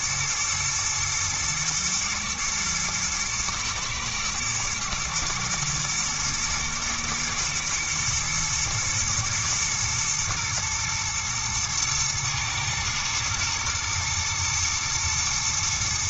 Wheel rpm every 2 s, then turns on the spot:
120, 120, 110, 110, 120, 120, 110, 120.
none